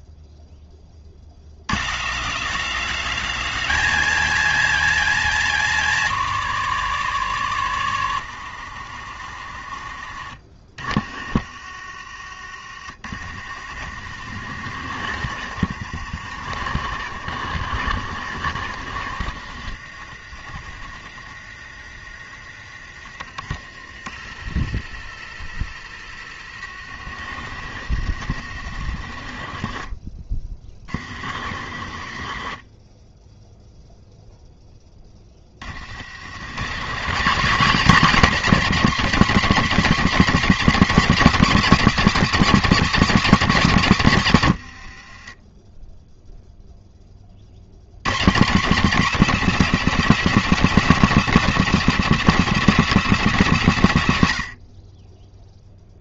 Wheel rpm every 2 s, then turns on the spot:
10, 190, 210, 150, 90, 50, 50, 70, 70, 60, 60, 40, 50, 60, 70, 40, 30, 10, 140, 250, 240, 230, 100, 0, 190, 240, 240, 90.
44-46